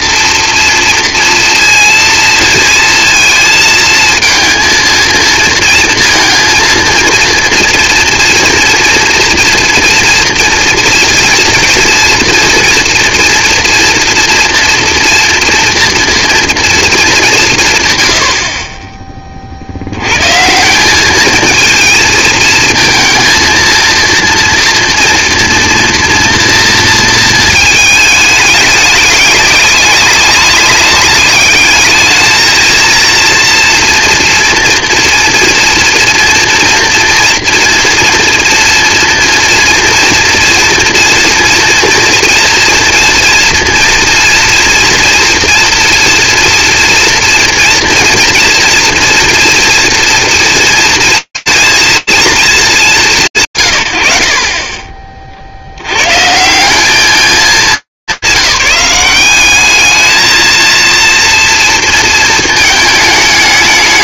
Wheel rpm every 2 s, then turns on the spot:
230, 230, 230, 230, 230, 230, 230, 230, 220, 40, 180, 230, 230, 230, 210, 200, 230, 230, 230, 240, 230, 230, 230, 230, 230, 230, 220, 70, 150, 190, 230, 220.
none